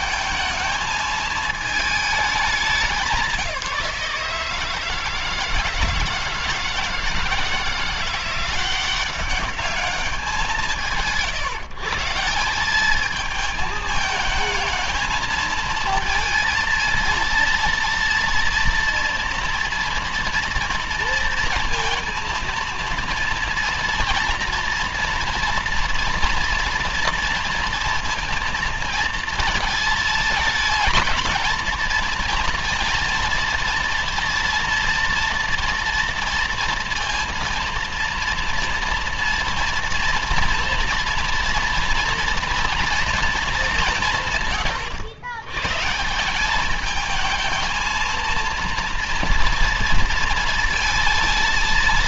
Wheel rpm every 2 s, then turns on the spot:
220, 170, 160, 160, 190, 160, 210, 230, 230, 230, 230, 230, 230, 230, 230, 220, 230, 230, 230, 230, 230, 230, 110, 220, 230, 230.
none